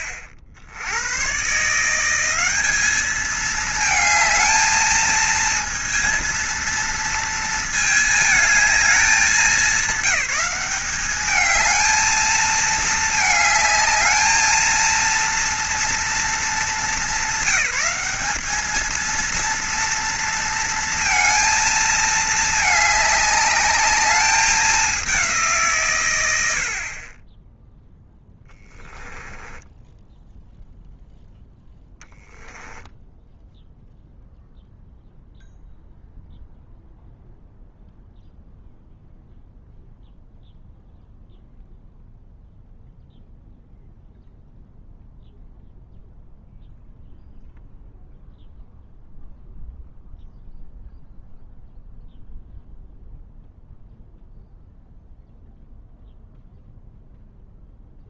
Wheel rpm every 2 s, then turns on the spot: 80, 210, 220, 230, 220, 200, 220, 220, 210, 210, 230, 210, 200, 60, 10, 0, 0, 0, 0, 0, 0, 0, 0, 0, 0, 0, 0, 0, 0.
26-30